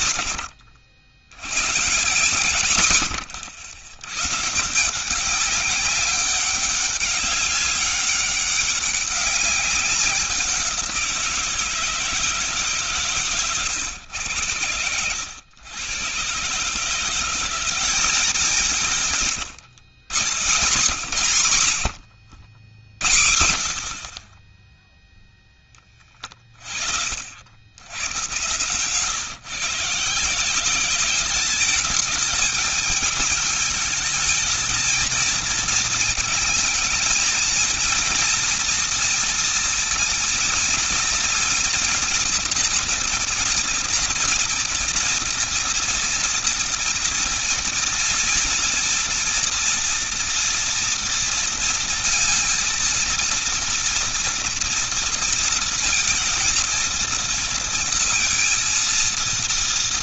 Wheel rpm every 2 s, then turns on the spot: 90, 170, 140, 200, 200, 180, 150, 100, 140, 180, 130, 80, 30, 30, 120, 170, 220, 220, 220, 230, 230, 230, 240, 240, 230, 230, 230, 230, 230, 230.
none